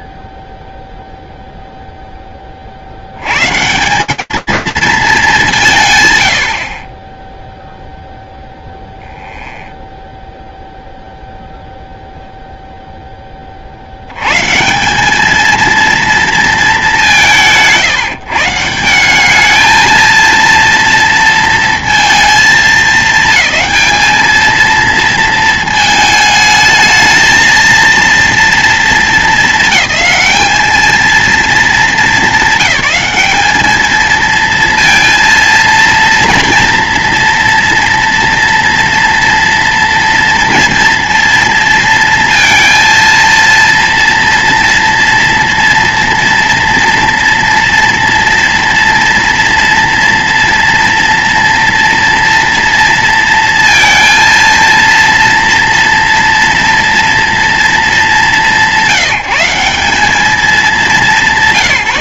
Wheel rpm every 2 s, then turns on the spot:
0, 160, 140, 0, 0, 0, 110, 220, 160, 220, 220, 220, 220, 230, 220, 190, 220, 230, 230, 230, 230, 230, 230, 230, 230, 230, 230, 230, 190, 200, 190.
none